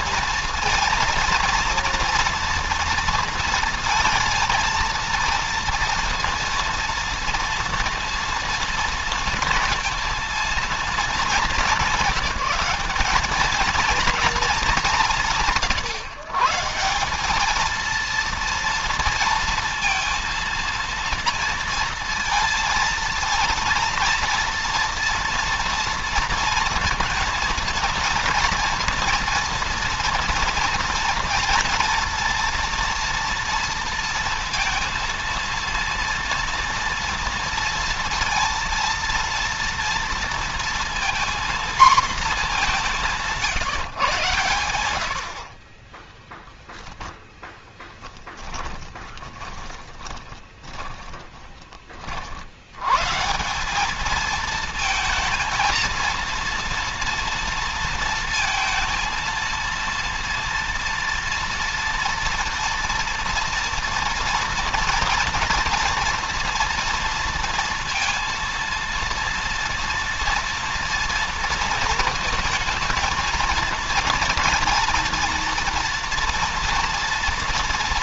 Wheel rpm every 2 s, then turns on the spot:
230, 230, 230, 230, 230, 230, 210, 230, 140, 230, 230, 230, 230, 230, 230, 230, 230, 230, 230, 230, 230, 220, 120, 10, 10, 30, 40, 210, 230, 230, 230, 230, 230, 240, 230, 230, 230, 230, 230.
48-52